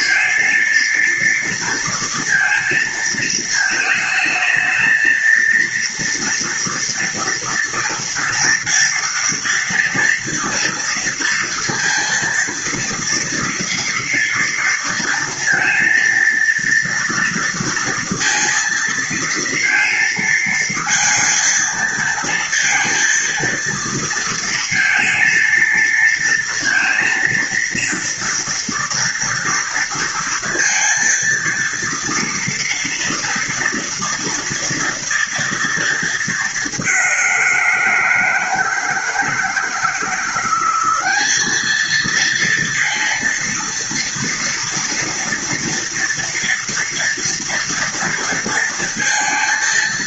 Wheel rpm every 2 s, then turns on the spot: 230, 230, 220, 230, 230, 230, 230, 230, 230, 230, 220, 230, 230, 230, 230, 230, 230, 230, 200, 160, 190, 230, 230, 230, 230.
none